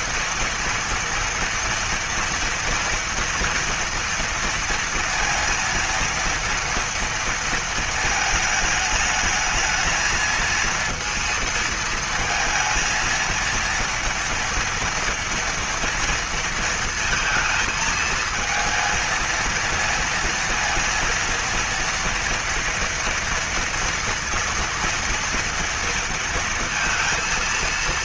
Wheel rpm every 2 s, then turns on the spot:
240, 230, 230, 230, 220, 230, 230, 230, 230, 220, 230, 230, 230, 230.
none